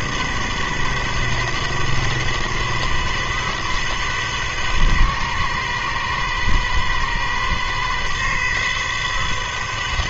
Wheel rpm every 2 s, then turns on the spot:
130, 130, 130, 130, 130.
none